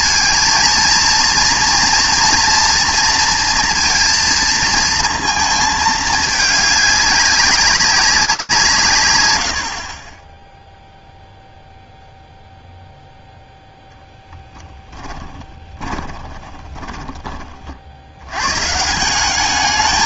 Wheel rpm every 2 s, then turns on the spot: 230, 230, 230, 210, 180, 10, 0, 10, 30, 140.
14-18